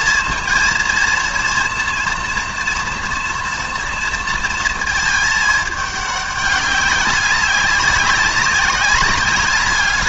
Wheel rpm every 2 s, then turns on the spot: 230, 230, 220, 200, 200.
none